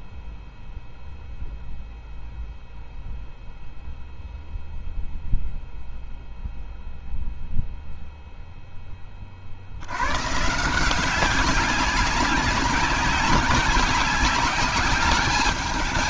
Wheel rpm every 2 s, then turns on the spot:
0, 0, 0, 0, 0, 150, 190, 190.
none